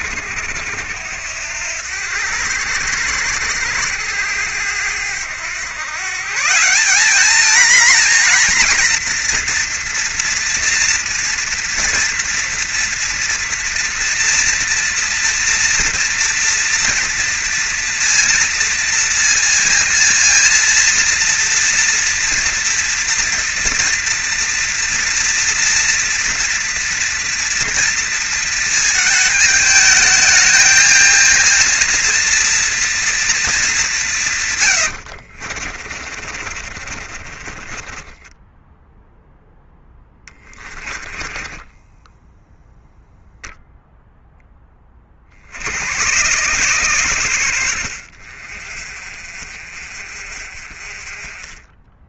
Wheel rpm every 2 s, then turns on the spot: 90, 80, 90, 190, 230, 230, 230, 230, 230, 230, 230, 230, 230, 230, 220, 220, 230, 100, 40, 10, 20, 0, 20, 120, 40, 30.
34-42 48-52